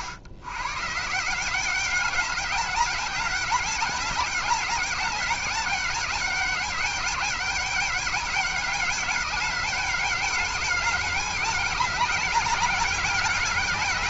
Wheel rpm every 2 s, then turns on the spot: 140, 200, 200, 200, 200, 190, 200.
none